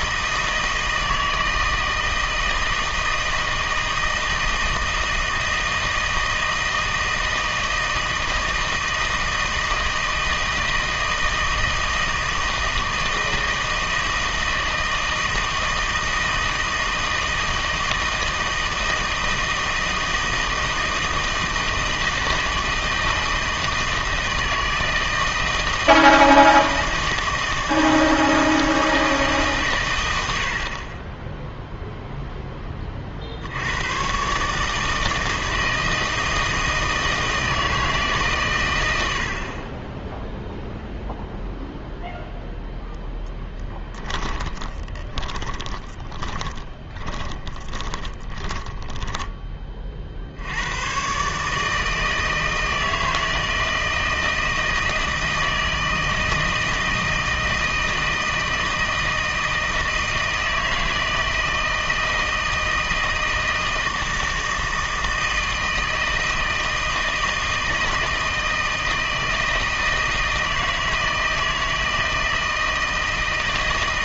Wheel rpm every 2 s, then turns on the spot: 160, 160, 160, 160, 160, 160, 160, 160, 160, 160, 160, 160, 160, 160, 160, 70, 10, 150, 160, 110, 0, 0, 20, 20, 20, 80, 160, 160, 160, 160, 160, 160, 160, 160, 160, 160, 160.
44-50